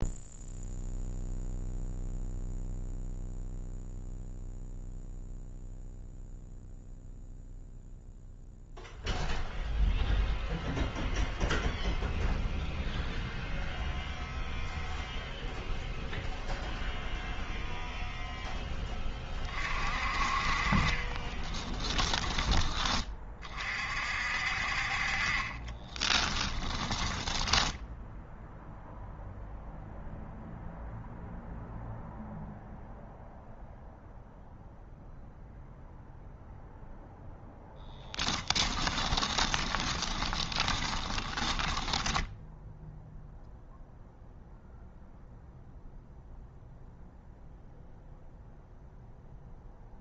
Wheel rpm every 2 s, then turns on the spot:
0, 0, 0, 0, 0, 0, 0, 0, 0, 10, 30, 20, 50, 20, 0, 0, 0, 0, 0, 20, 20, 0, 0, 0, 0.
26-28 38-42